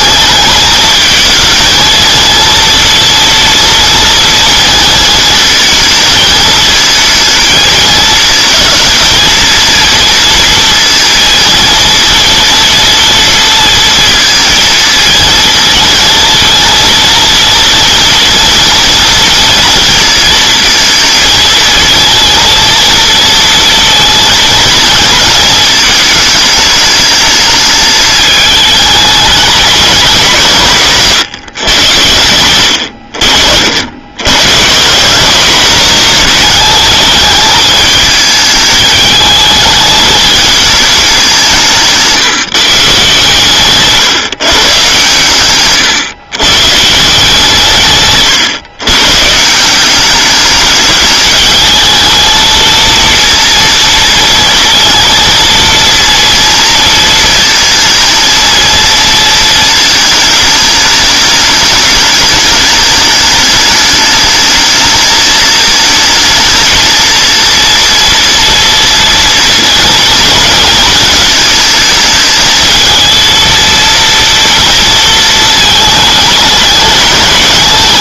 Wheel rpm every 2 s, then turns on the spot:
220, 230, 230, 220, 220, 230, 230, 230, 230, 230, 230, 230, 230, 220, 210, 160, 90, 150, 210, 210, 220, 150, 130, 140, 120, 210, 230, 230, 230, 230, 210, 210, 220, 220, 230, 230, 220, 230, 210.
none